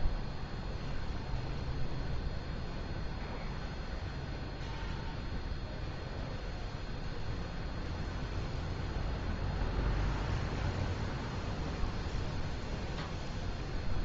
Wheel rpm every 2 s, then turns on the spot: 0, 0, 0, 0, 0, 0, 0.
none